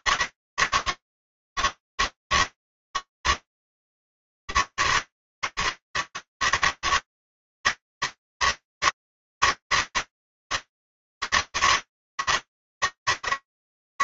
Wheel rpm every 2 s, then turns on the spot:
140, 140, 140, 150, 140, 150, 160.
none